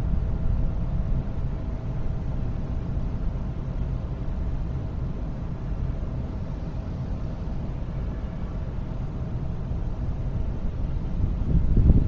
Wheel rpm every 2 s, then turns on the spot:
0, 0, 0, 0, 0, 0.
none